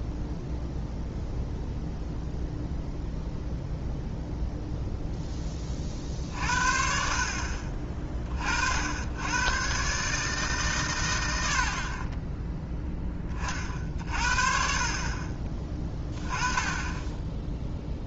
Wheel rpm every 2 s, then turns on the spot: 0, 0, 0, 50, 70, 120, 10, 40, 10.
none